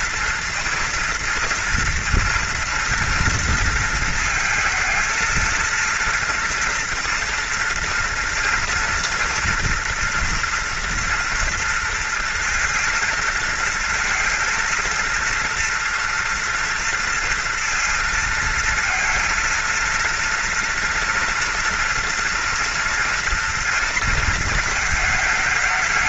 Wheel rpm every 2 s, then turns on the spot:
230, 230, 230, 230, 230, 230, 230, 230, 230, 220, 230, 230, 230.
none